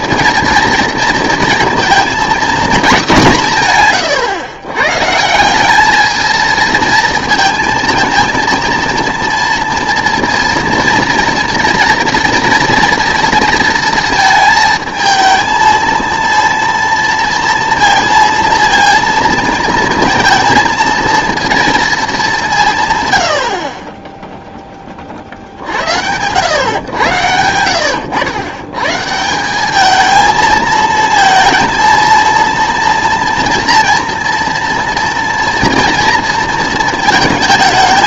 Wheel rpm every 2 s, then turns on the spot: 230, 230, 130, 220, 230, 240, 230, 220, 230, 230, 230, 160, 10, 110, 130, 230, 230, 230, 230.
none